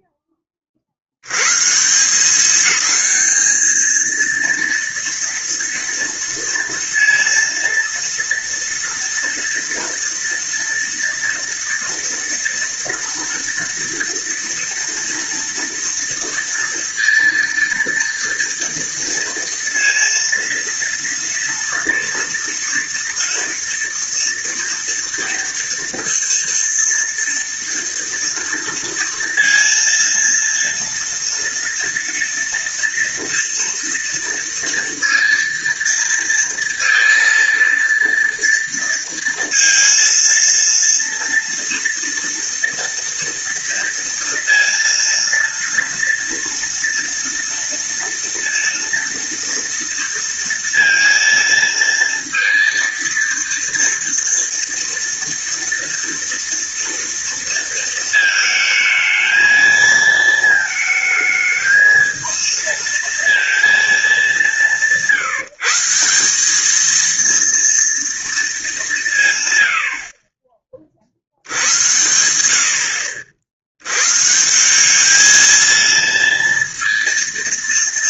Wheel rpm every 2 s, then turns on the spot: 80, 220, 230, 230, 230, 230, 230, 230, 230, 230, 230, 240, 240, 230, 230, 230, 230, 230, 230, 230, 230, 230, 230, 230, 230, 230, 230, 230, 230, 220, 220, 230, 170, 230, 170, 50, 60, 200, 230.
none